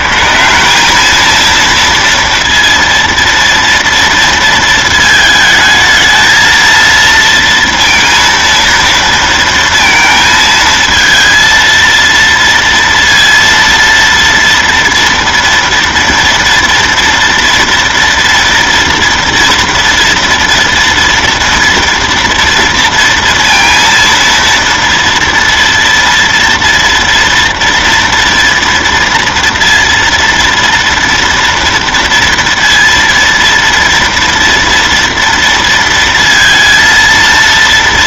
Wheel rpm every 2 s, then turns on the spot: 90, 230, 230, 220, 230, 220, 230, 230, 230, 230, 230, 230, 230, 230, 230, 230, 230, 230, 230.
none